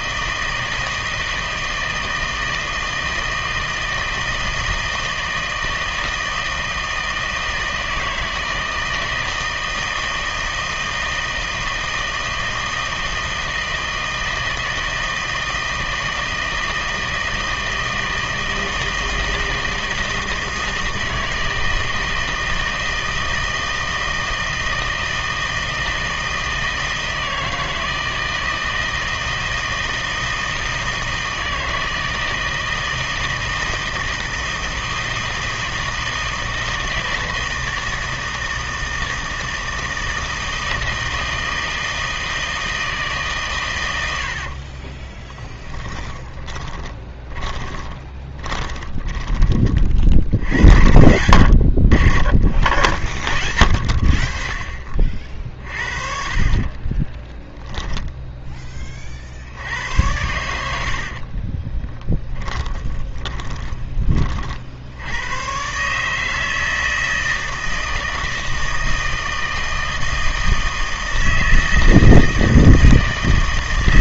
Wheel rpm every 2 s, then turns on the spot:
160, 160, 160, 160, 160, 160, 160, 160, 160, 160, 160, 160, 160, 160, 160, 160, 160, 160, 160, 160, 160, 160, 50, 20, 20, 80, 40, 40, 40, 10, 80, 20, 50, 160, 160, 160, 160.
44-50 62-64